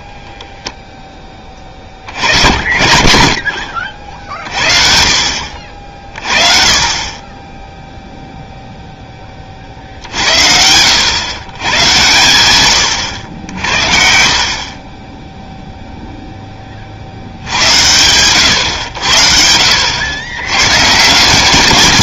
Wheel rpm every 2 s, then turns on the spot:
0, 80, 50, 30, 0, 70, 100, 40, 30, 100, 120.
none